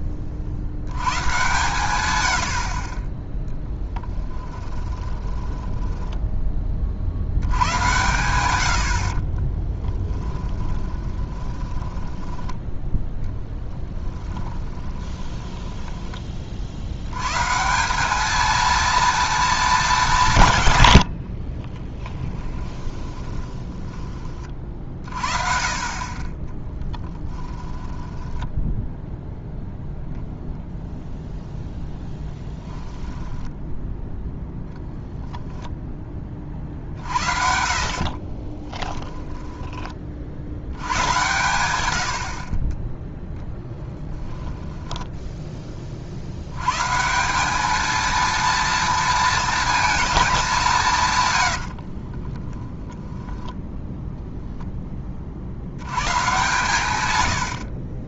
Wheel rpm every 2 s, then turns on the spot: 60, 50, 20, 20, 90, 10, 10, 20, 60, 220, 110, 20, 40, 10, 10, 0, 10, 0, 50, 10, 80, 30, 10, 120, 230, 180, 10, 0, 120.
4-6 10-12 14-16 22-24 26-30 32-34 38-40 44-46 52-54